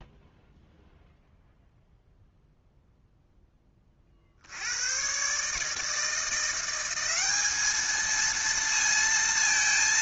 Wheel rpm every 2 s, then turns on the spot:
0, 0, 70, 170, 230.
none